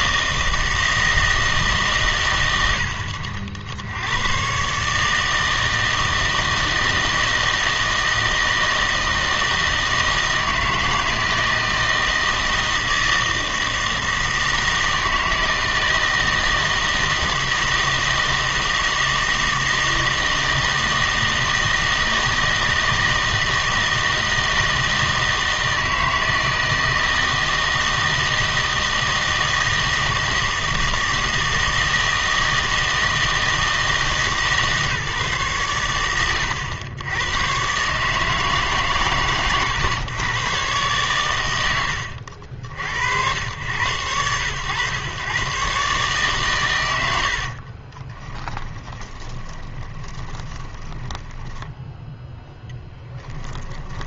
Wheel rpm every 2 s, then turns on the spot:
160, 80, 140, 160, 160, 160, 160, 160, 160, 160, 160, 160, 160, 160, 160, 160, 160, 150, 110, 140, 120, 70, 110, 100, 20, 20, 0.
48-52